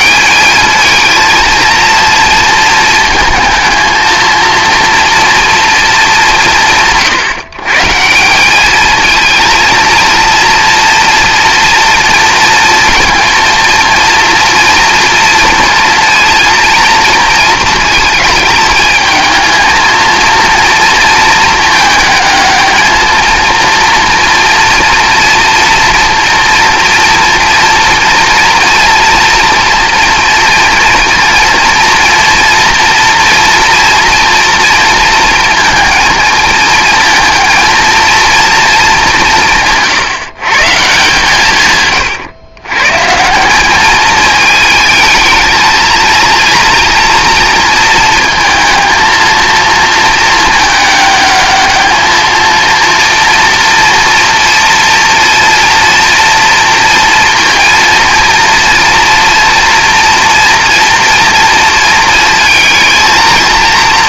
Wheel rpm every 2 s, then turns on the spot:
220, 220, 230, 150, 210, 230, 230, 230, 230, 220, 230, 220, 230, 240, 240, 230, 230, 230, 230, 210, 150, 130, 220, 230, 220, 210, 230, 230, 230, 230, 230, 230.
none